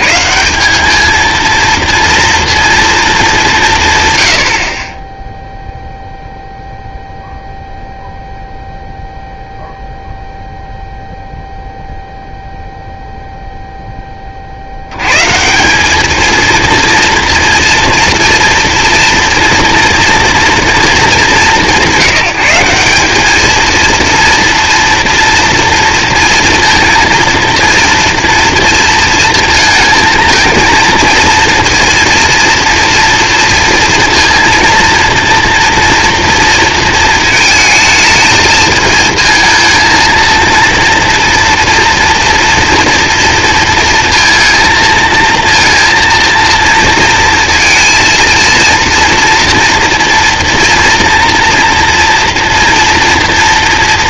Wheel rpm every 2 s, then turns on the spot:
180, 230, 70, 0, 0, 0, 0, 50, 230, 230, 230, 180, 230, 230, 230, 230, 230, 230, 230, 220, 230, 240, 230, 230, 230, 230, 230.
none